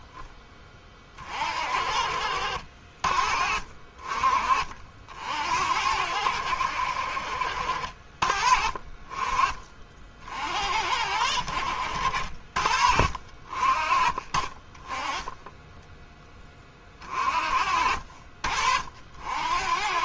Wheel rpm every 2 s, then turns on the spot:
40, 50, 60, 60, 30, 70, 50, 30, 40, 60.
none